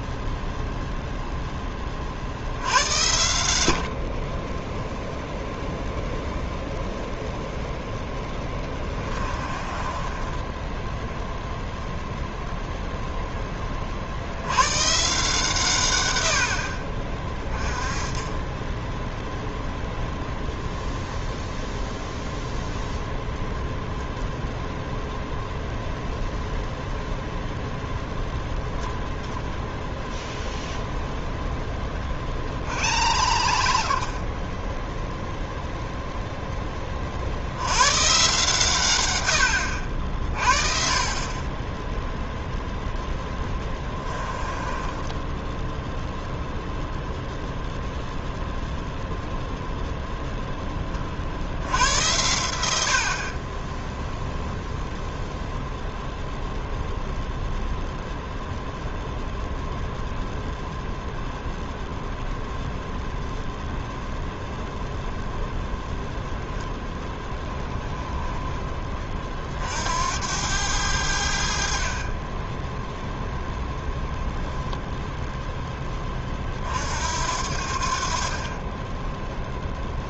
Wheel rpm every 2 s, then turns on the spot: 0, 80, 0, 0, 20, 10, 0, 130, 40, 10, 0, 0, 0, 0, 10, 10, 70, 0, 20, 120, 40, 10, 20, 0, 0, 20, 70, 0, 0, 0, 0, 0, 0, 10, 20, 90, 10, 0, 50, 20.
8-12 42-46